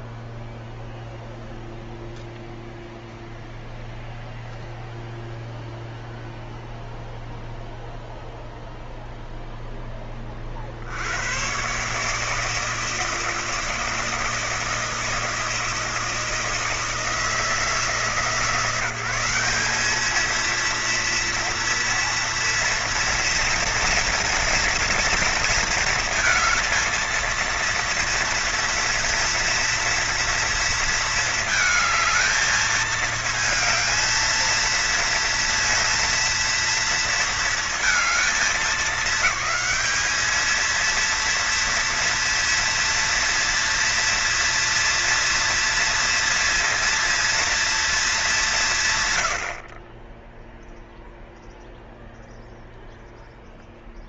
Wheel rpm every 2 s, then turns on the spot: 0, 0, 0, 0, 0, 70, 160, 160, 160, 170, 230, 230, 230, 230, 230, 230, 220, 230, 230, 210, 220, 230, 230, 230, 160, 0, 0.
none